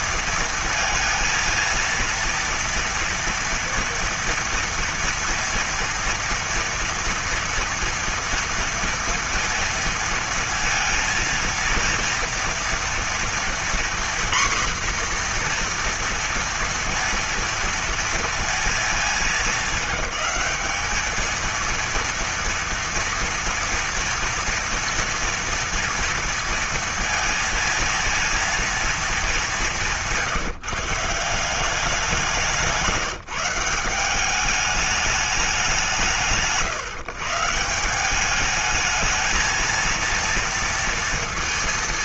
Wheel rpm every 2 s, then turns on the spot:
230, 230, 230, 230, 230, 230, 230, 250, 230, 230, 210, 230, 240, 230, 230, 170, 180, 200, 150, 210, 230.
none